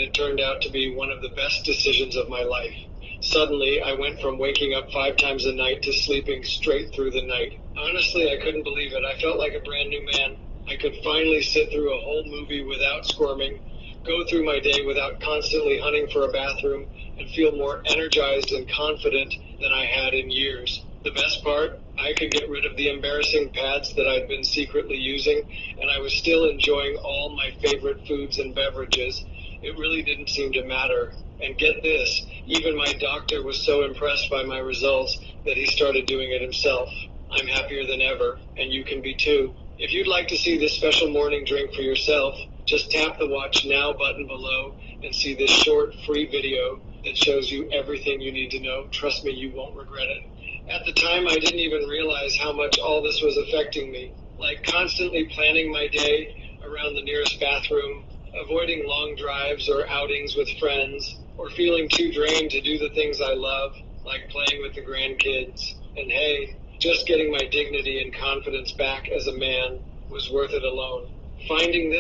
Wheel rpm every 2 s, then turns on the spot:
0, 0, 0, 0, 0, 0, 0, 0, 0, 0, 0, 0, 0, 0, 0, 0, 0, 0, 0, 0, 0, 0, 0, 0, 0, 0, 0, 0, 0, 0, 0, 0, 0, 0, 0, 0.
none